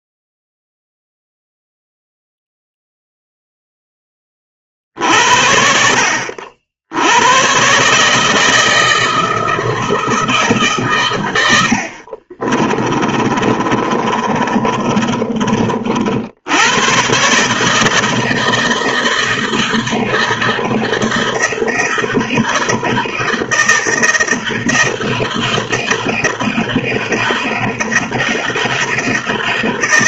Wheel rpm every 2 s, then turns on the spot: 0, 0, 30, 60, 160, 150, 40, 40, 90, 160, 160, 160, 160, 160, 160.
12-16